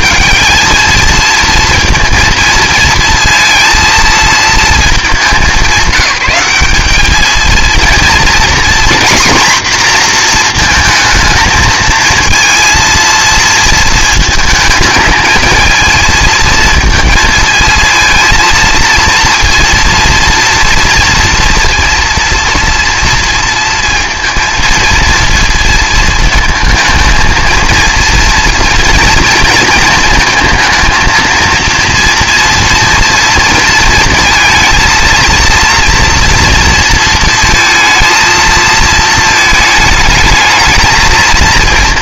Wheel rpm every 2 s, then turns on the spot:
210, 230, 220, 190, 240, 230, 230, 220, 220, 230, 230, 240, 230, 220, 230, 230, 230, 230, 230, 230, 220.
none